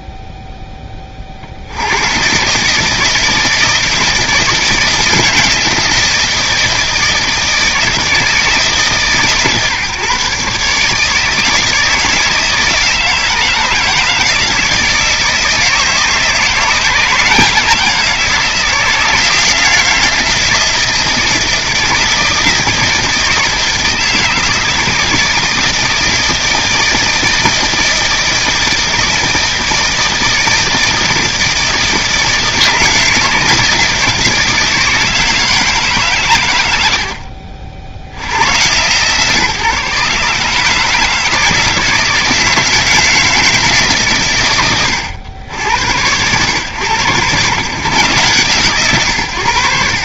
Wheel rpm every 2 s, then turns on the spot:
70, 160, 170, 160, 150, 160, 160, 160, 160, 160, 160, 160, 160, 160, 160, 160, 160, 160, 50, 140, 160, 160, 70, 110, 90.
none